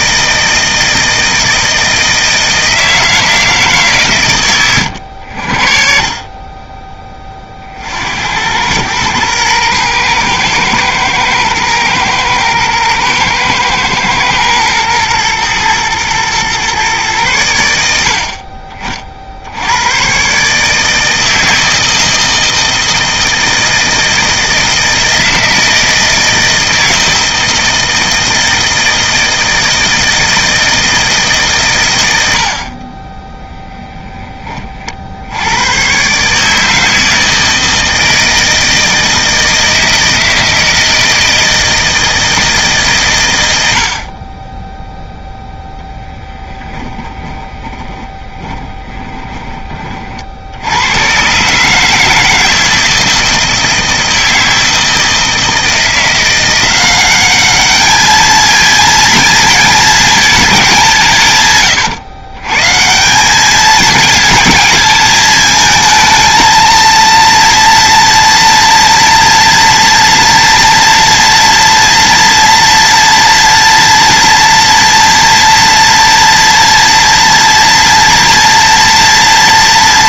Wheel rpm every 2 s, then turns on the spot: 160, 160, 90, 20, 110, 110, 110, 110, 120, 40, 150, 160, 160, 160, 160, 160, 30, 50, 160, 160, 160, 140, 0, 10, 20, 100, 160, 160, 190, 230, 180, 160, 220, 230, 230, 230, 230, 230, 240, 230.
46-50